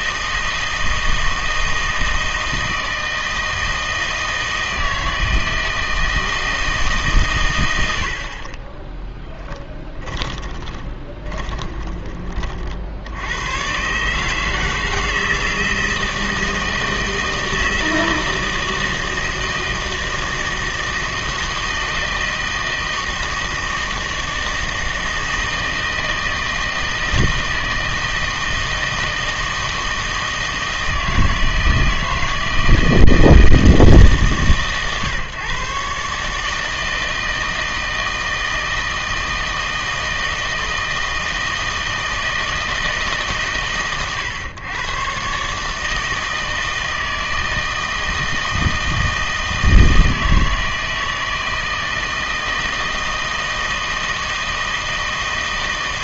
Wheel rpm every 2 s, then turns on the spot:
160, 160, 160, 160, 30, 20, 60, 160, 160, 160, 160, 160, 160, 160, 160, 160, 160, 140, 160, 160, 160, 160, 120, 160, 160, 160, 160, 160.
8-12